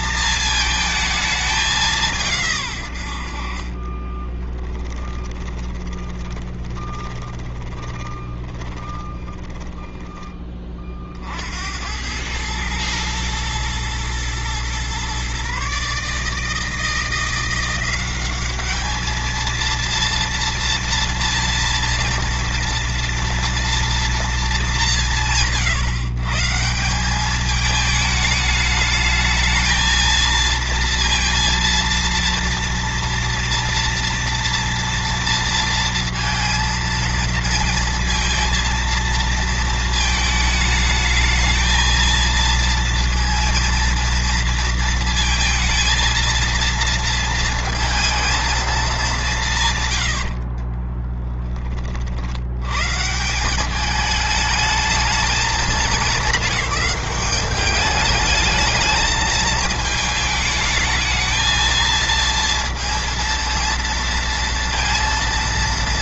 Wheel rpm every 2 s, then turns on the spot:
220, 120, 10, 20, 20, 30, 110, 120, 160, 210, 230, 230, 200, 170, 210, 230, 230, 230, 230, 230, 220, 230, 230, 230, 210, 30, 110, 220, 190, 210, 210, 230, 230.
4-10 50-52